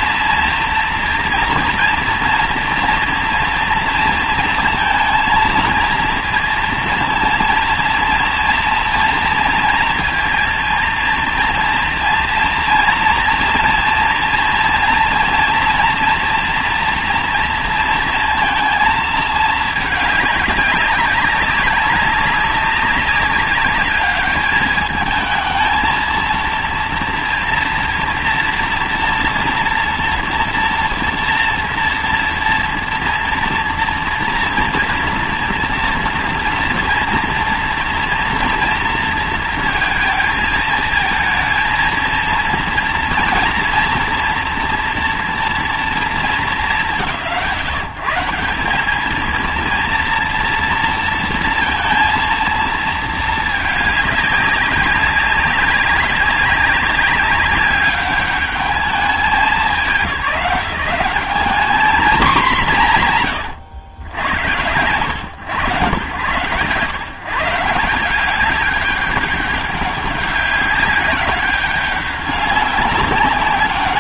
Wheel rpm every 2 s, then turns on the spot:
230, 230, 230, 230, 230, 230, 230, 230, 230, 230, 200, 200, 210, 230, 230, 230, 230, 230, 240, 230, 220, 230, 230, 200, 180, 230, 230, 190, 190, 200, 180, 200, 90, 140, 200, 190, 200.
none